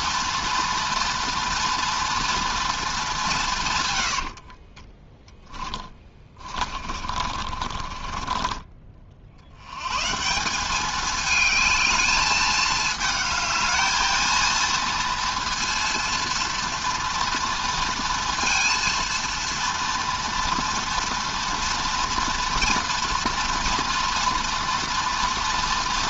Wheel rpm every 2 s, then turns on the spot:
240, 220, 40, 40, 40, 200, 220, 230, 230, 230, 230, 240, 230.
4-8